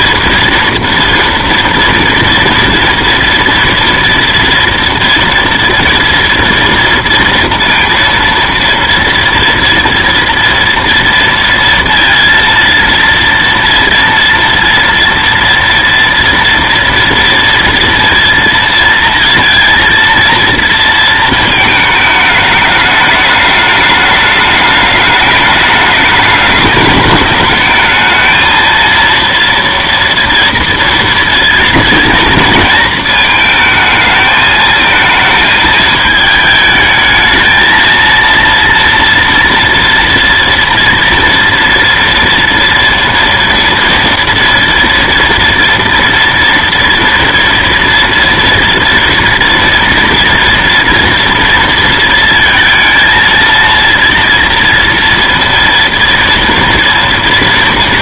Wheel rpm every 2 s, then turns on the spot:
230, 230, 230, 230, 230, 230, 230, 230, 230, 230, 230, 210, 210, 210, 220, 230, 230, 220, 220, 230, 230, 230, 230, 230, 230, 230, 230, 230, 230.
none